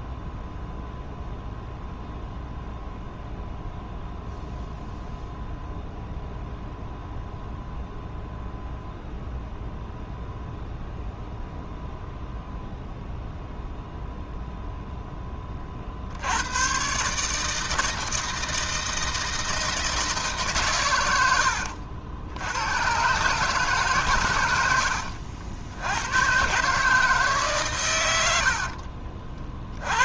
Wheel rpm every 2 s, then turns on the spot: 0, 0, 0, 0, 0, 0, 0, 0, 110, 160, 140, 100, 100, 140, 60.
28-30